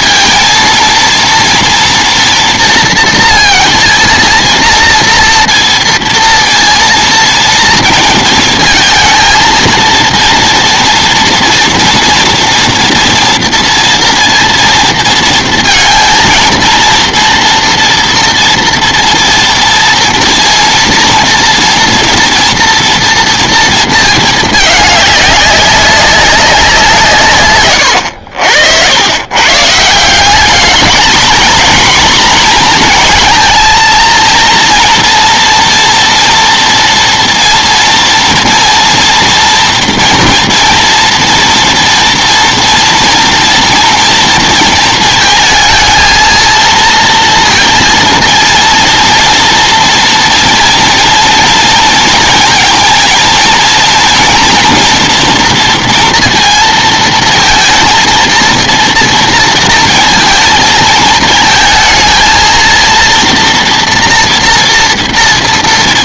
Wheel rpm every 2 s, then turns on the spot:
230, 230, 230, 230, 220, 230, 230, 230, 230, 230, 230, 230, 210, 170, 90, 220, 230, 230, 240, 240, 240, 230, 230, 230, 230, 230, 230, 230, 230, 230, 220, 230, 230.
none